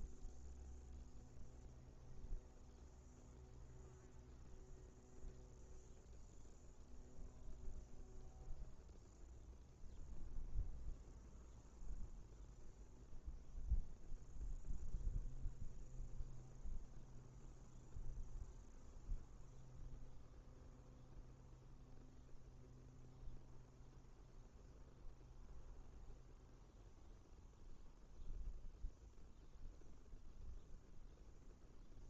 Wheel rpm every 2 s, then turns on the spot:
0, 0, 0, 0, 0, 0, 0, 0, 0, 0, 0, 0, 0, 0, 0, 0.
none